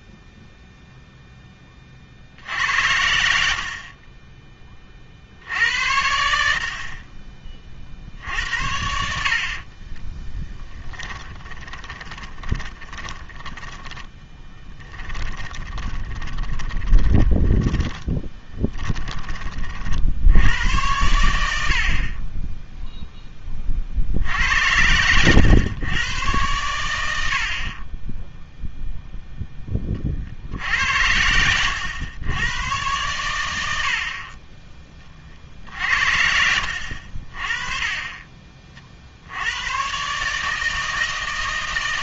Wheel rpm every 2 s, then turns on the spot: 0, 70, 20, 70, 50, 10, 20, 10, 10, 10, 90, 10, 80, 110, 0, 70, 110, 20, 70, 40, 150.
10-20